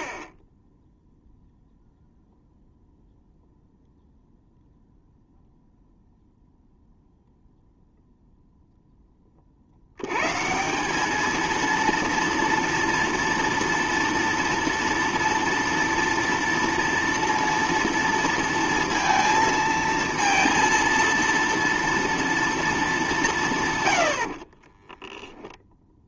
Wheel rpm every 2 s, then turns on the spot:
10, 0, 0, 0, 0, 160, 230, 230, 230, 230, 230, 230, 40.
24-26